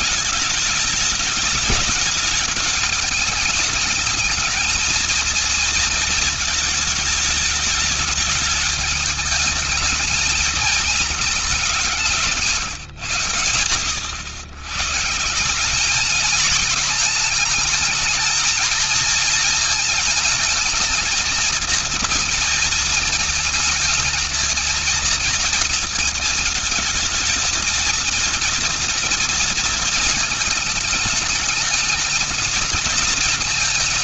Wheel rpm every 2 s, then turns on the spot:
200, 210, 220, 220, 210, 220, 150, 120, 220, 230, 220, 220, 220, 220, 230, 220, 220.
none